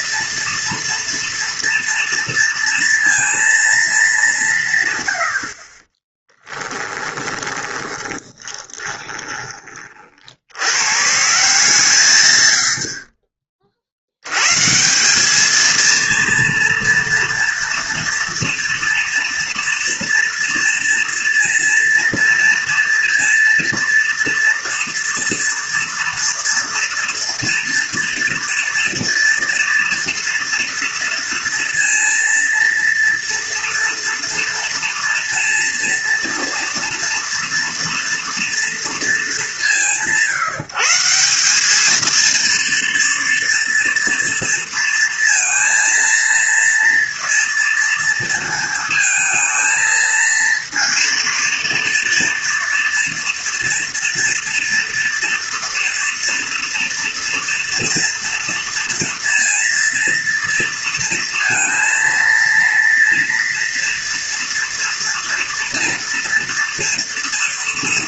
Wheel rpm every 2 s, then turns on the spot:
230, 230, 120, 20, 20, 130, 60, 180, 230, 230, 230, 230, 230, 230, 230, 230, 230, 230, 230, 220, 160, 230, 230, 230, 220, 230, 230, 230, 230, 230, 230, 230, 230, 230.
6-10